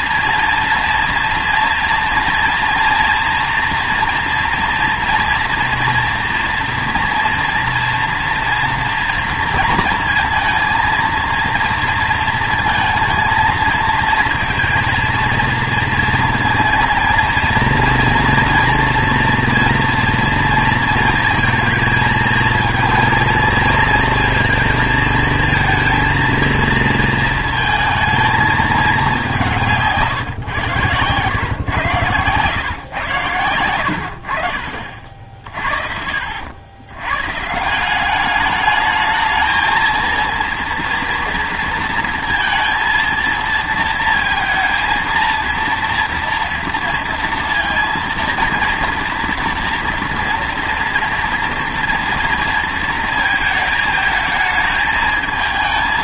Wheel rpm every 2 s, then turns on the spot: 240, 230, 230, 230, 230, 230, 220, 230, 230, 240, 230, 230, 230, 230, 210, 120, 120, 50, 90, 210, 230, 230, 230, 230, 230, 230, 230, 220.
none